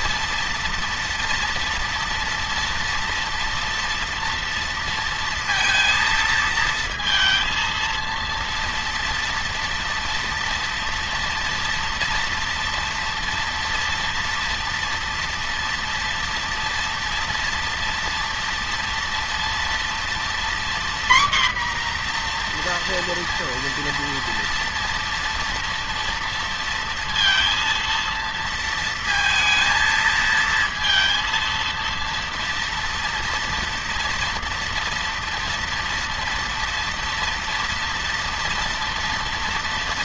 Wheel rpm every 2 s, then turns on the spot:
230, 230, 230, 230, 230, 230, 230, 230, 230, 230, 240, 240, 230, 230, 230, 230, 230, 230, 230, 230.
none